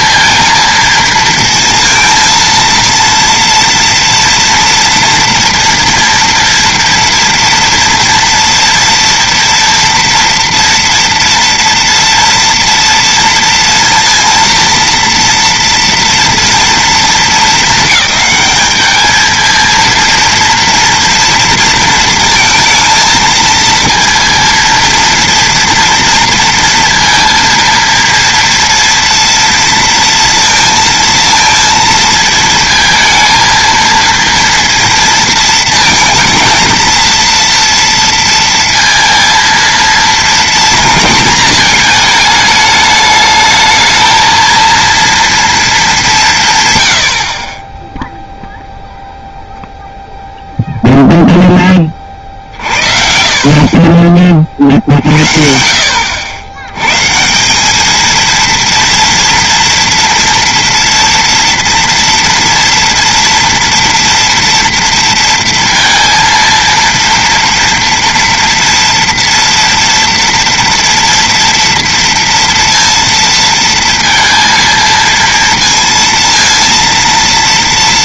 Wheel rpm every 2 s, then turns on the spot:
230, 230, 230, 230, 230, 230, 230, 230, 230, 210, 230, 230, 230, 230, 230, 230, 220, 230, 230, 230, 220, 210, 230, 120, 0, 0, 60, 50, 100, 230, 230, 230, 230, 230, 230, 230, 230, 230, 230.
none